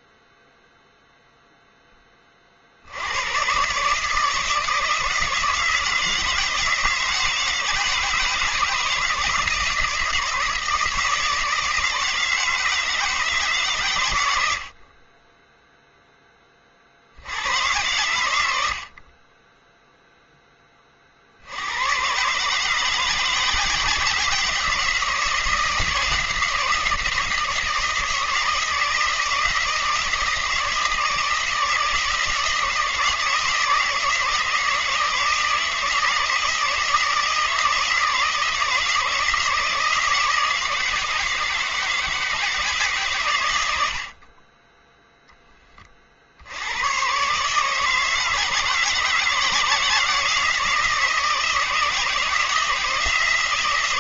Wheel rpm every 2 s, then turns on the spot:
0, 60, 160, 160, 160, 160, 160, 60, 30, 80, 20, 150, 160, 170, 160, 160, 160, 160, 160, 160, 160, 160, 20, 90, 160, 160, 160.
none